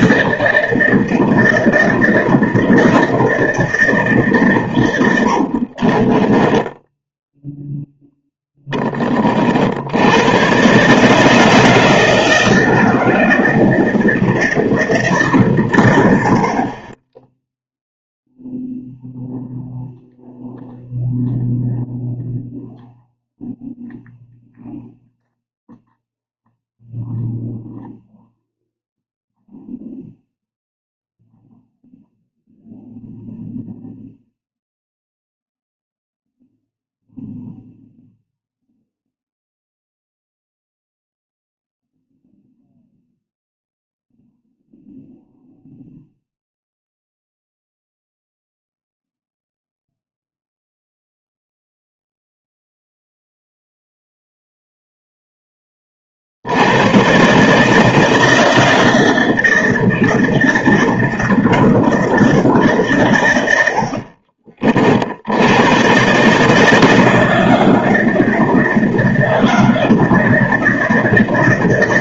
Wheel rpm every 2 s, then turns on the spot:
160, 170, 110, 10, 20, 140, 160, 160, 30, 0, 0, 0, 0, 0, 0, 0, 0, 0, 0, 0, 0, 0, 0, 0, 0, 0, 0, 0, 110, 160, 160, 130, 50, 160, 160, 160.
6-8